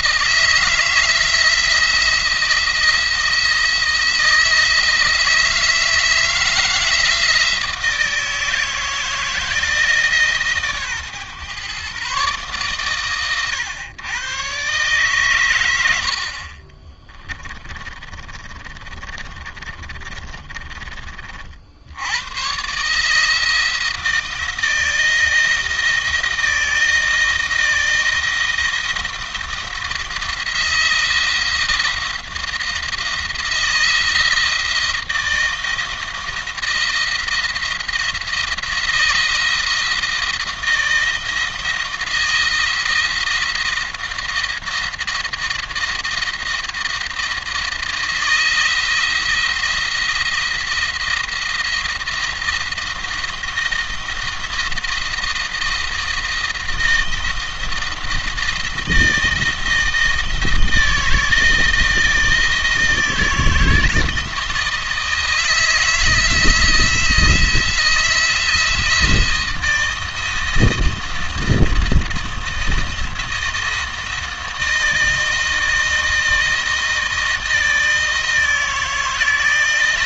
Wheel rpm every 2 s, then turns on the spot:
170, 170, 160, 170, 170, 140, 130, 120, 30, 30, 30, 140, 170, 170, 170, 170, 170, 170, 170, 170, 170, 160, 170, 160, 170, 170, 170, 170, 170, 160, 170, 160, 160, 170, 170, 170, 160, 160, 160, 160.
16-20